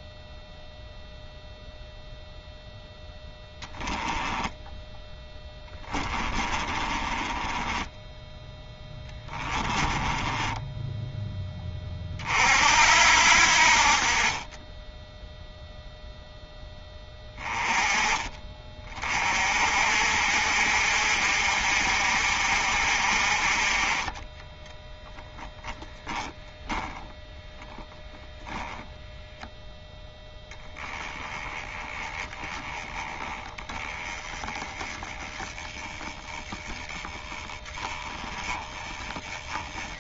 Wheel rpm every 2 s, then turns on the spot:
0, 10, 10, 20, 10, 10, 60, 10, 10, 30, 50, 50, 10, 10, 0, 10, 10, 10, 10, 20.
4-12 24-26